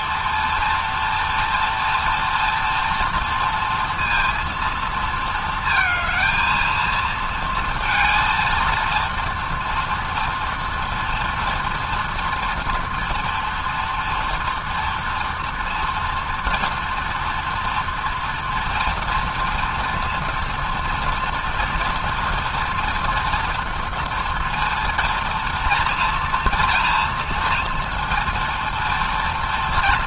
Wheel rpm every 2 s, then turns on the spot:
230, 230, 220, 230, 230, 230, 230, 240, 230, 230, 230, 240, 230, 230, 230.
none